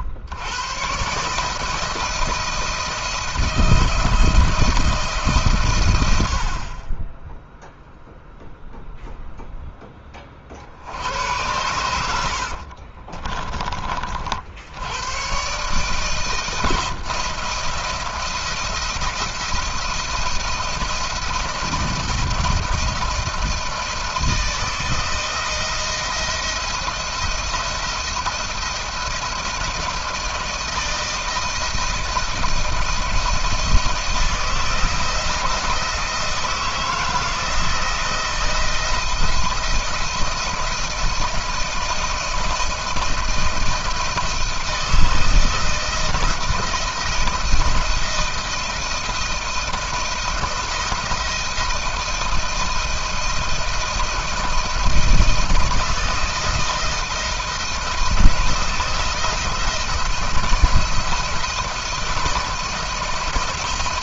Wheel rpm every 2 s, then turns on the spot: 90, 160, 160, 60, 0, 50, 60, 70, 160, 170, 170, 160, 160, 170, 170, 160, 170, 170, 160, 160, 160, 160, 160, 160, 160, 170, 160, 160, 160, 160, 170, 170.
12-14